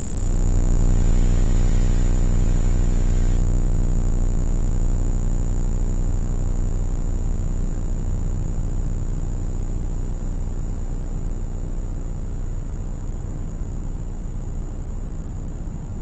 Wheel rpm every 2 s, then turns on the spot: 0, 0, 0, 0, 0, 0, 0, 0.
none